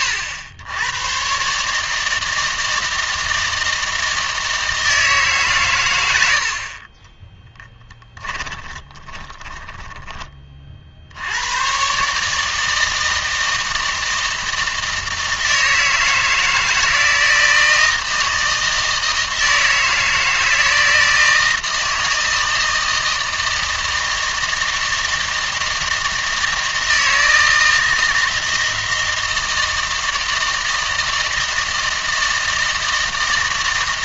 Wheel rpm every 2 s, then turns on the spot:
80, 160, 160, 40, 20, 50, 160, 160, 160, 160, 160, 160, 160, 160, 160, 160, 160.
8-10